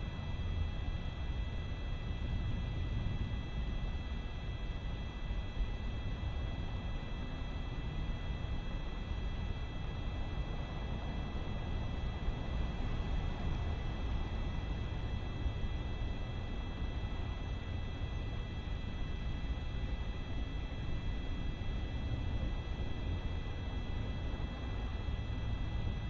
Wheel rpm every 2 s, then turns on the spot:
0, 0, 0, 0, 0, 0, 0, 0, 0, 0, 0, 0, 0.
none